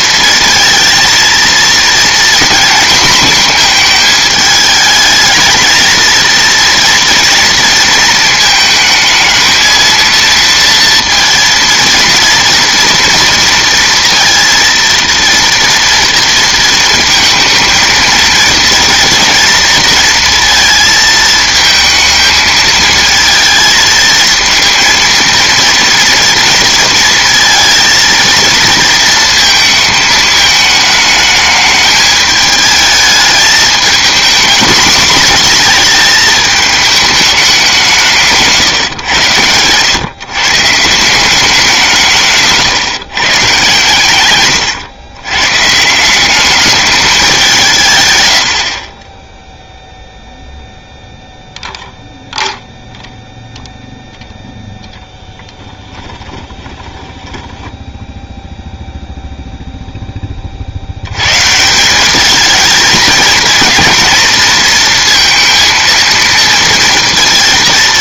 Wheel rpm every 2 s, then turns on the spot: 220, 230, 220, 230, 220, 230, 230, 230, 230, 230, 230, 220, 230, 230, 230, 210, 210, 240, 220, 150, 150, 140, 120, 210, 70, 0, 0, 0, 20, 0, 50, 220, 230, 230.
48-50 56-58